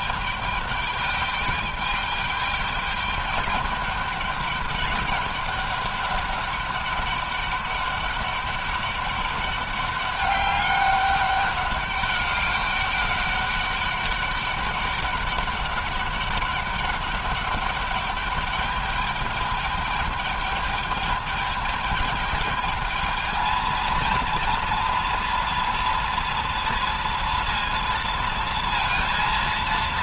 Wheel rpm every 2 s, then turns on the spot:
210, 210, 200, 200, 200, 200, 200, 200, 200, 200, 210, 210, 230, 230, 230.
none